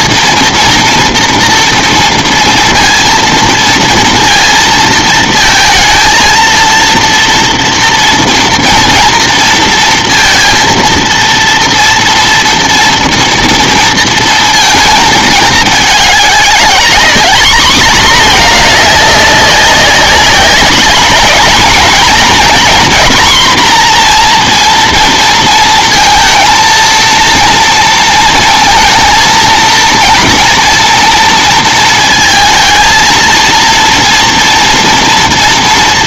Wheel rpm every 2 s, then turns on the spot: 230, 230, 230, 230, 230, 230, 230, 220, 210, 210, 210, 240, 230, 230, 230, 230, 230, 230.
none